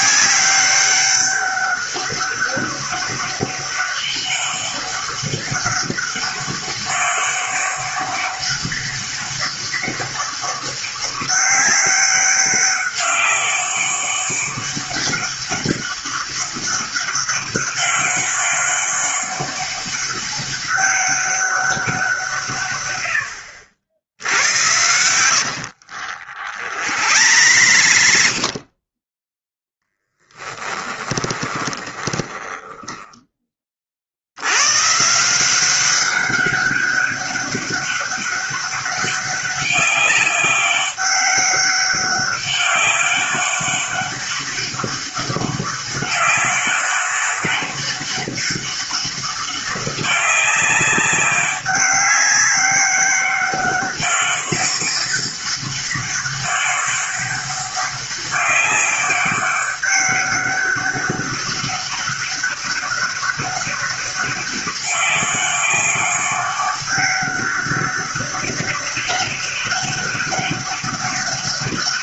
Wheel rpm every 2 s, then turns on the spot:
190, 200, 200, 200, 200, 200, 200, 200, 200, 200, 200, 110, 80, 60, 30, 10, 10, 130, 200, 200, 200, 200, 200, 200, 200, 200, 200, 200, 200, 200, 200, 200, 200, 200, 200, 200.
24-28 30-34